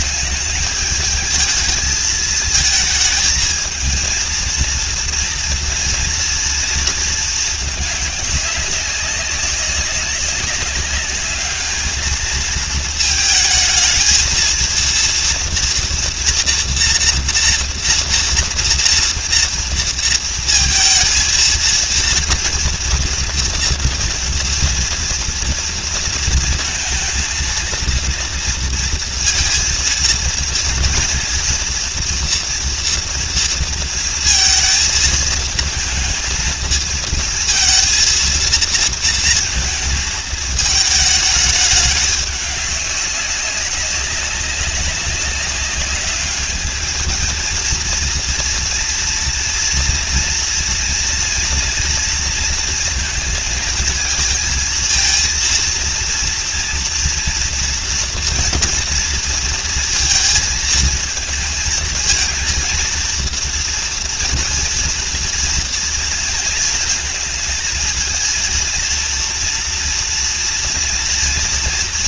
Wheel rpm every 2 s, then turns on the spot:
210, 220, 230, 230, 200, 200, 220, 230, 240, 230, 230, 240, 230, 220, 230, 230, 240, 230, 220, 230, 220, 200, 200, 210, 230, 230, 230, 230, 230, 230, 220, 230, 230, 230, 230, 230.
none